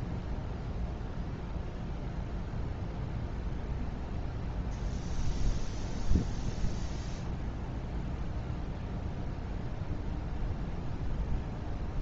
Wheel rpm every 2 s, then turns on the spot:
0, 0, 0, 0, 0, 0.
none